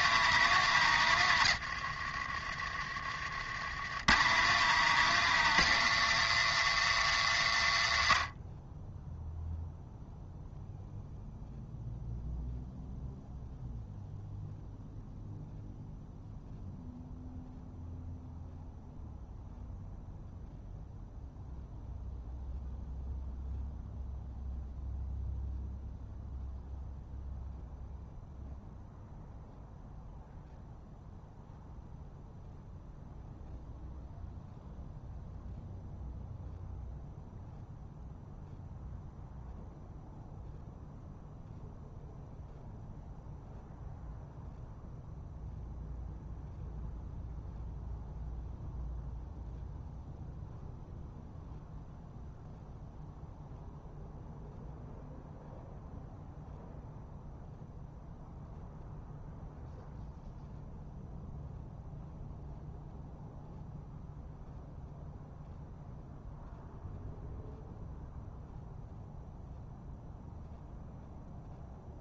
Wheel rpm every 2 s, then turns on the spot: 120, 50, 150, 110, 10, 0, 0, 0, 0, 0, 0, 0, 0, 0, 0, 0, 0, 0, 0, 0, 0, 0, 0, 0, 0, 0, 0, 0, 0, 0, 0, 0, 0, 0, 0, 0.
none